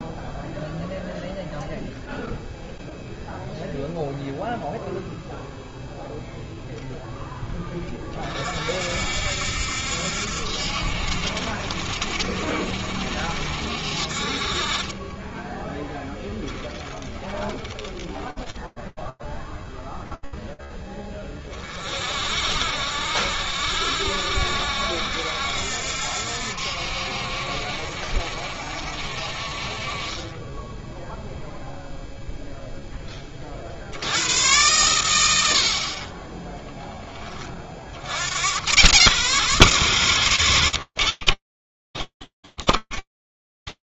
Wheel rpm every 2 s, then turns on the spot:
0, 0, 0, 0, 50, 70, 70, 40, 20, 0, 10, 60, 70, 70, 60, 0, 50, 70, 40, 130, 50, 50.
16-18